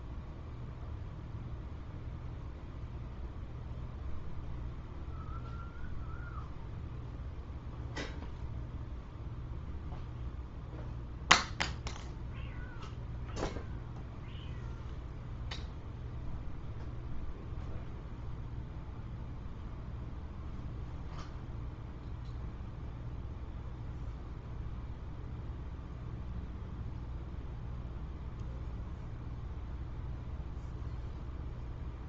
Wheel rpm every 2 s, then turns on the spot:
0, 0, 0, 0, 0, 0, 0, 0, 0, 0, 0, 0, 0, 0, 0, 0.
none